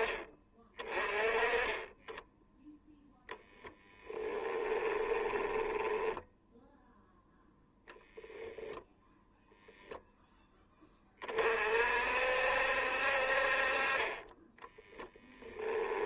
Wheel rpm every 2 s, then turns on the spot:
30, 0, 20, 0, 0, 20, 60, 10.
4-6 14-16